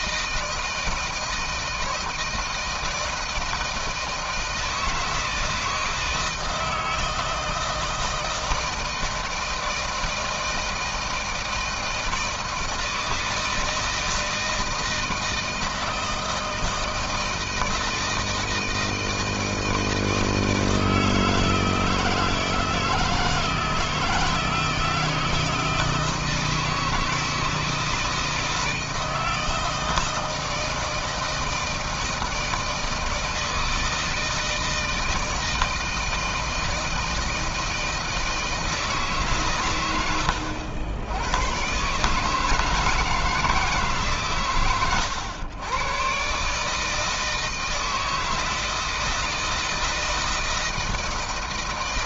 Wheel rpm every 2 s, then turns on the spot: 160, 160, 160, 160, 160, 160, 160, 160, 160, 160, 160, 160, 160, 160, 160, 160, 160, 160, 160, 160, 100, 160, 130, 130, 160, 160.
none